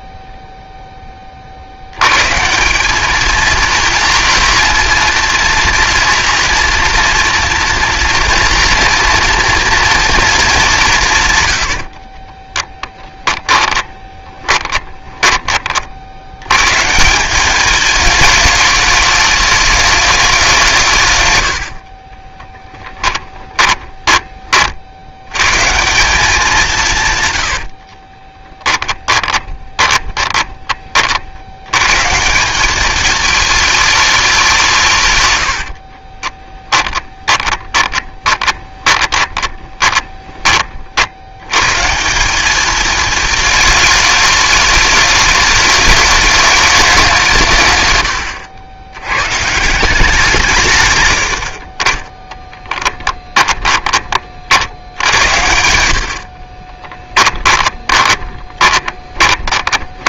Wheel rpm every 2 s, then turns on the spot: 0, 180, 230, 240, 230, 180, 10, 20, 170, 210, 140, 10, 100, 130, 20, 80, 220, 100, 20, 20, 70, 220, 210, 180, 100, 110, 20, 80, 20, 20.
12-16 22-24 26-30 34-40 52-54 56-60